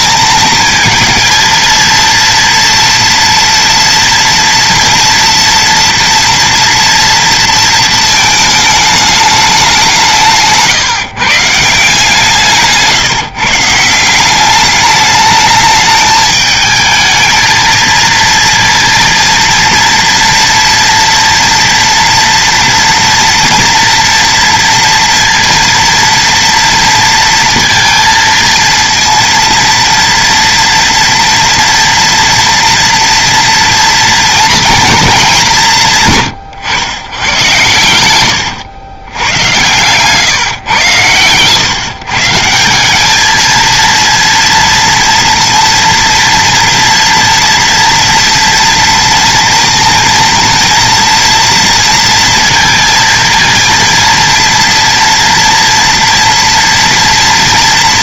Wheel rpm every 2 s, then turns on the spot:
220, 230, 240, 240, 220, 160, 160, 180, 220, 230, 230, 230, 230, 230, 230, 230, 230, 230, 120, 100, 140, 140, 230, 230, 230, 230, 230, 230, 230.
38-40